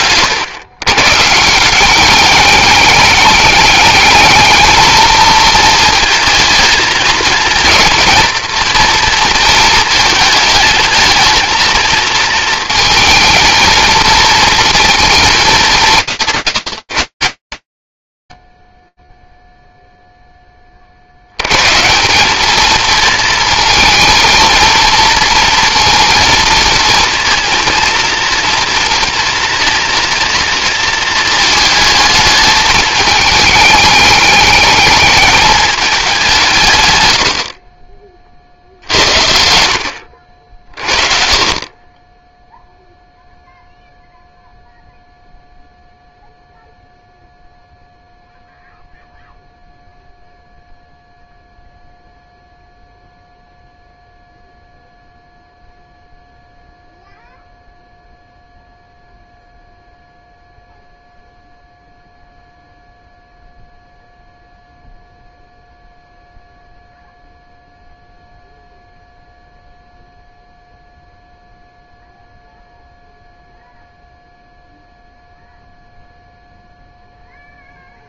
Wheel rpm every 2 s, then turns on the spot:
150, 210, 220, 230, 230, 220, 220, 220, 130, 0, 80, 220, 230, 230, 230, 230, 220, 220, 70, 60, 40, 0, 0, 0, 0, 0, 0, 0, 0, 0, 0, 0, 0, 0, 0, 0, 0, 0, 0.
none